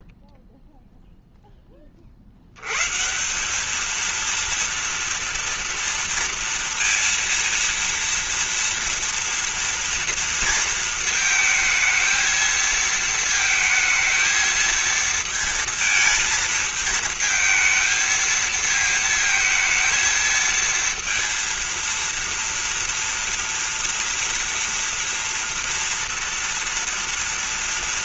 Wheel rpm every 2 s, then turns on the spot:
0, 90, 230, 230, 230, 230, 220, 220, 220, 220, 230, 230, 230, 230.
none